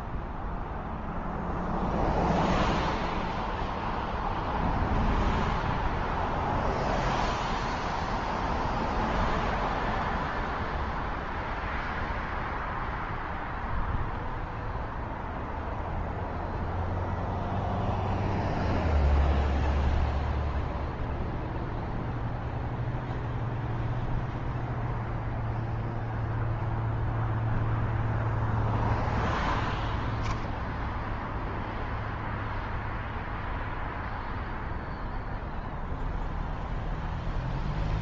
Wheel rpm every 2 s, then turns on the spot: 0, 0, 0, 0, 0, 0, 0, 0, 0, 0, 0, 0, 0, 0, 10, 0, 0, 0, 0.
none